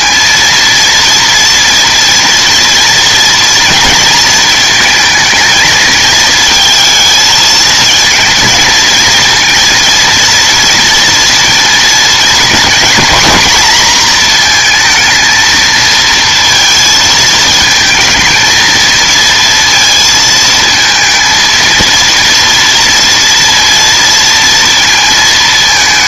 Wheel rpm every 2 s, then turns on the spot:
230, 230, 220, 220, 230, 230, 230, 230, 230, 220, 220, 230, 230.
none